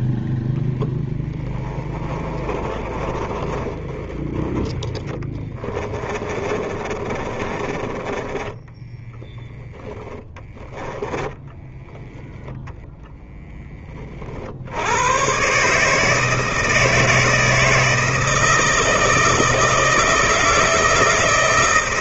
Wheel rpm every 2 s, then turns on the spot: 0, 20, 20, 30, 10, 10, 0, 60, 160, 160, 160.
2-4 6-10